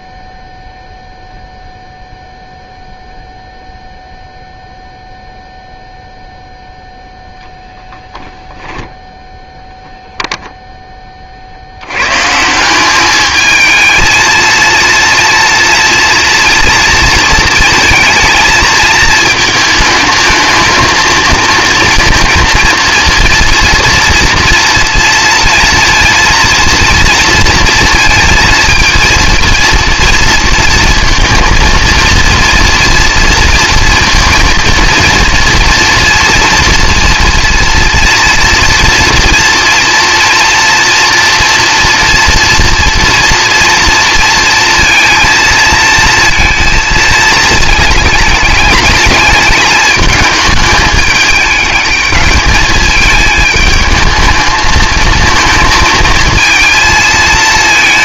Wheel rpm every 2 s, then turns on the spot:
0, 0, 0, 0, 0, 0, 180, 230, 230, 220, 220, 230, 230, 230, 230, 230, 230, 230, 230, 230, 230, 230, 230, 230, 210, 210, 210, 220, 230.
none